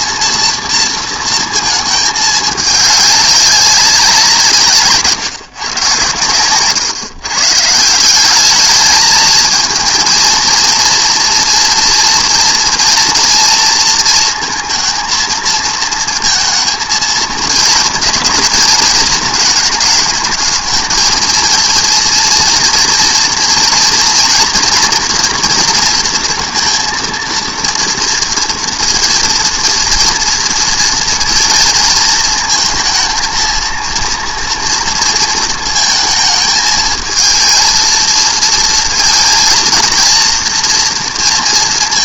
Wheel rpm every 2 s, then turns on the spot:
230, 210, 160, 130, 210, 230, 230, 220, 230, 230, 220, 230, 230, 230, 230, 230, 230, 230, 220, 230, 230.
none